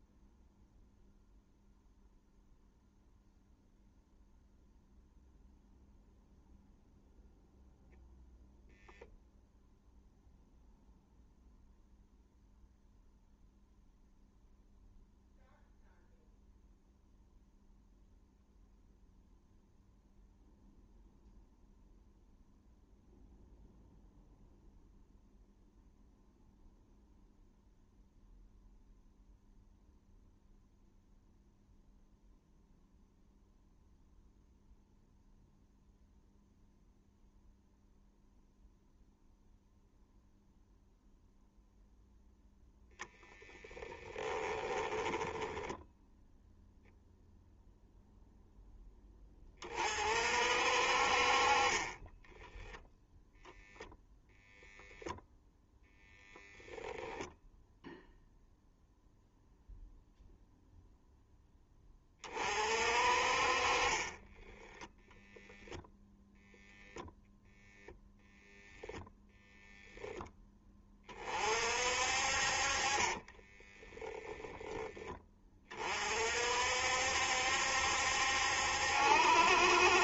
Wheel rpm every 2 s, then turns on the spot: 0, 0, 0, 0, 0, 0, 0, 0, 0, 0, 0, 0, 0, 0, 0, 0, 0, 0, 0, 0, 0, 0, 10, 0, 10, 50, 0, 0, 0, 0, 0, 40, 0, 0, 0, 20, 30, 10, 60, 70.
44-46 72-74